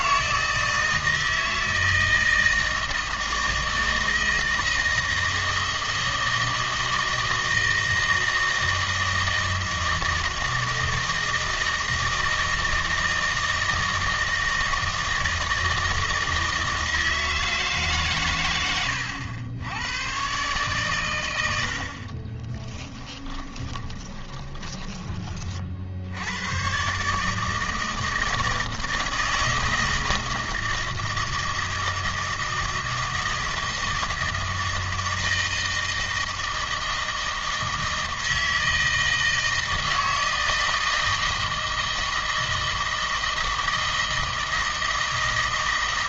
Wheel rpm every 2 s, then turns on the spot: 160, 160, 160, 160, 160, 160, 160, 160, 160, 110, 140, 30, 20, 120, 160, 160, 160, 160, 160, 160, 160, 160, 160.
22-26